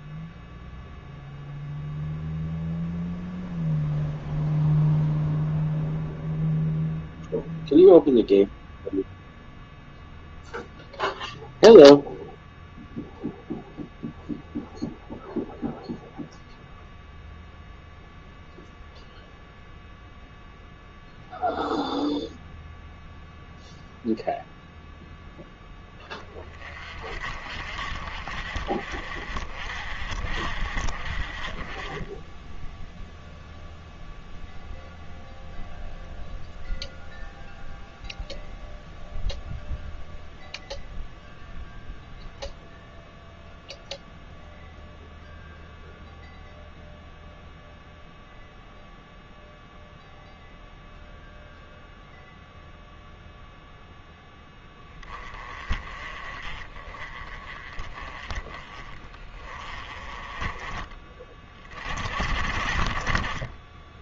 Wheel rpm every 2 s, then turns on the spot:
0, 0, 0, 0, 0, 0, 0, 0, 0, 0, 0, 0, 0, 40, 40, 40, 0, 0, 0, 0, 0, 0, 0, 0, 0, 0, 0, 20, 30, 20, 20, 30.
none